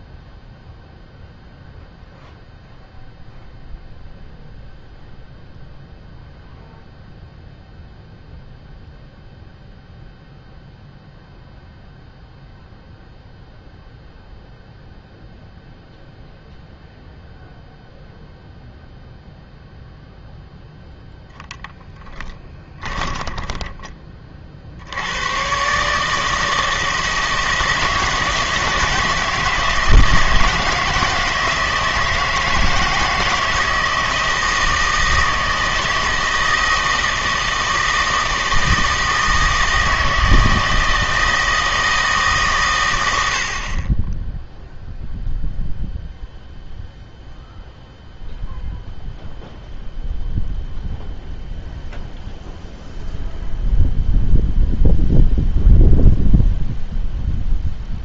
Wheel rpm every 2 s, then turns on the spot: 0, 0, 0, 0, 0, 0, 0, 0, 0, 0, 0, 20, 60, 160, 160, 160, 160, 160, 160, 160, 160, 130, 0, 0, 0, 0, 0, 0, 0.
22-24